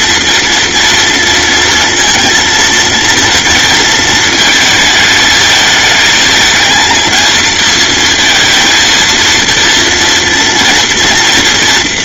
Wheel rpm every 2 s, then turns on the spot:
230, 230, 220, 230, 230, 230.
none